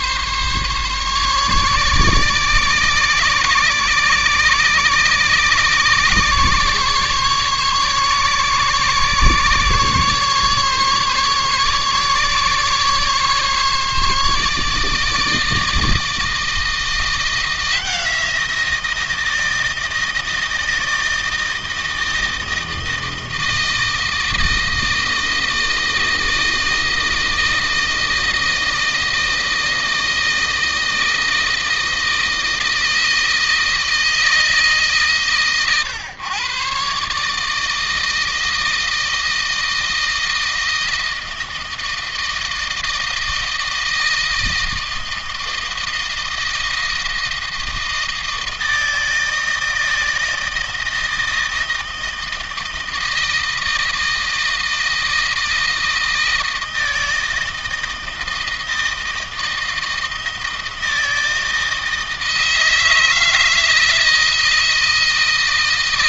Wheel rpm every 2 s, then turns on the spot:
140, 140, 140, 140, 140, 140, 140, 150, 170, 170, 160, 160, 160, 160, 160, 160, 160, 150, 140, 160, 160, 160, 160, 160, 160, 160, 160, 160, 160, 160, 160, 160, 160.
none